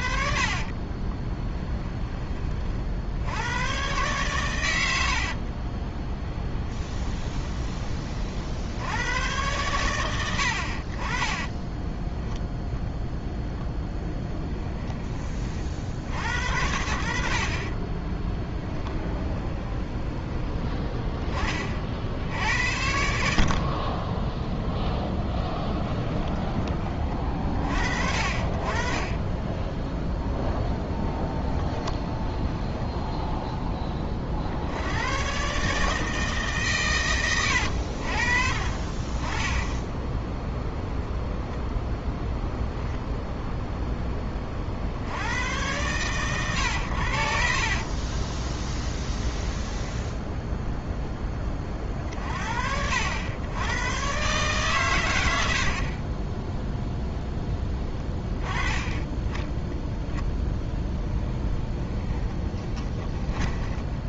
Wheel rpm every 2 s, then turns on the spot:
30, 50, 80, 20, 90, 50, 0, 20, 60, 20, 20, 80, 10, 30, 30, 10, 10, 90, 130, 30, 0, 0, 60, 90, 10, 0, 80, 120, 0, 10, 0, 20.
0-2 6-8 18-20 24-26 48-50 62-64